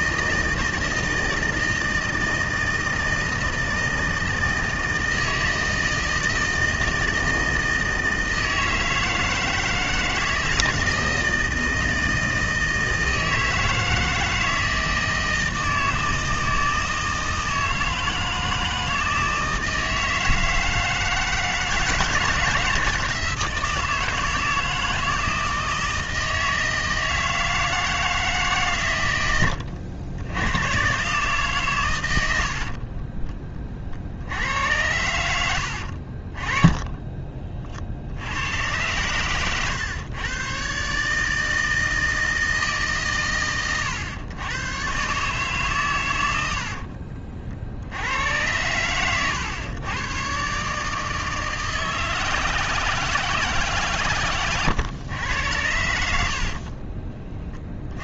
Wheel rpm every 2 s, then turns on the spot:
160, 160, 160, 160, 160, 160, 160, 160, 160, 160, 160, 160, 160, 160, 140, 110, 60, 90, 20, 100, 130, 160, 120, 60, 100, 150, 160, 110, 40.
32-34 36-38 46-48 56-58